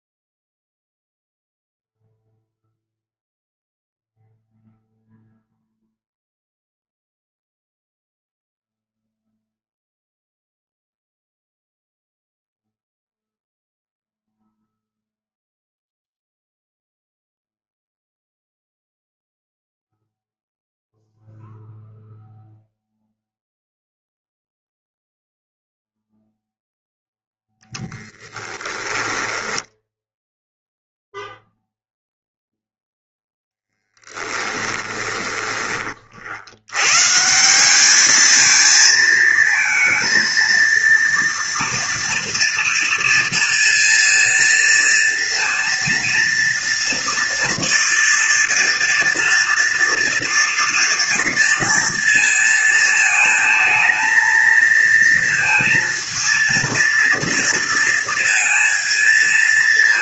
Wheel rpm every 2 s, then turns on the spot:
0, 0, 0, 0, 0, 0, 0, 0, 0, 0, 0, 0, 0, 0, 10, 0, 0, 10, 110, 220, 230, 230, 230, 230, 230, 230, 230, 230, 230, 230.
28-30 34-36